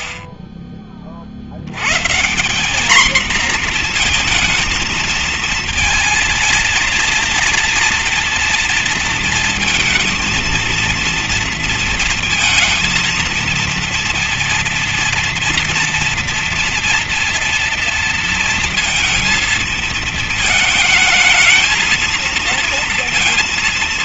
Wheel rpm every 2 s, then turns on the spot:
30, 190, 230, 230, 240, 220, 230, 230, 230, 230, 220, 230.
none